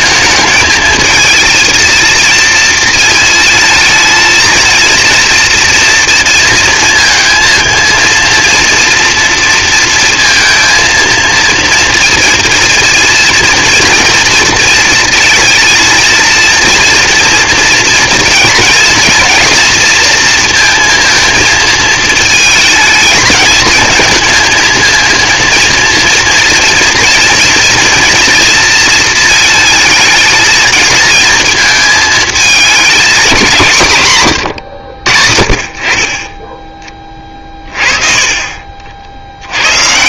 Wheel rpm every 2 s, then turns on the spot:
220, 220, 230, 230, 230, 230, 230, 230, 230, 230, 230, 220, 220, 230, 230, 220, 220, 110, 20, 50.
none